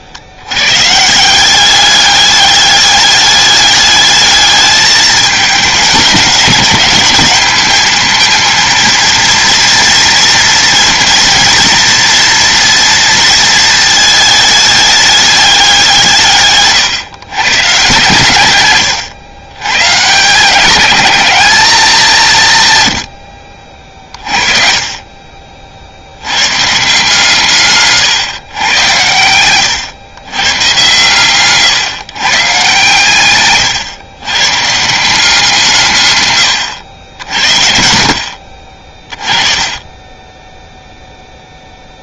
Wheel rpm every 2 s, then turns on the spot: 120, 210, 210, 200, 230, 230, 230, 210, 130, 120, 210, 120, 40, 140, 120, 130, 140, 160, 90, 40, 0.
none